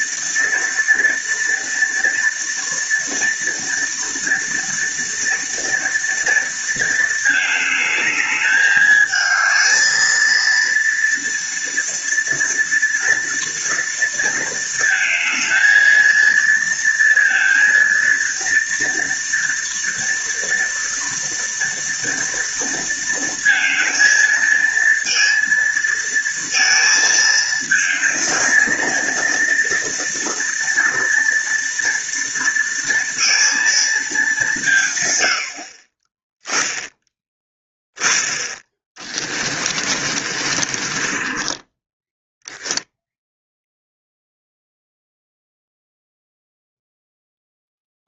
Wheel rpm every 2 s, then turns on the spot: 230, 230, 230, 230, 210, 230, 230, 230, 230, 230, 230, 230, 230, 230, 220, 230, 230, 190, 20, 20, 40, 10, 0, 0.
38-42